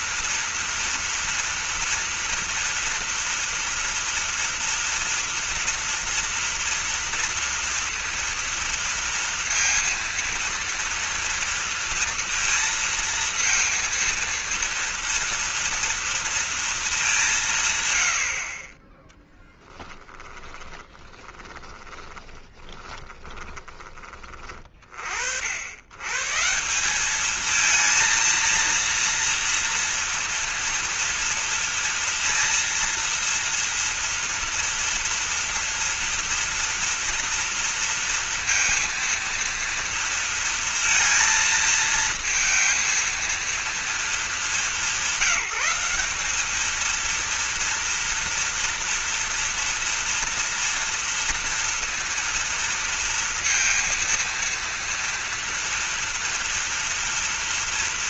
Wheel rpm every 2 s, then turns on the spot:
240, 230, 230, 230, 230, 230, 230, 230, 220, 20, 40, 20, 50, 180, 230, 240, 230, 230, 230, 230, 230, 220, 190, 230, 240, 230, 230, 230, 230.
20-24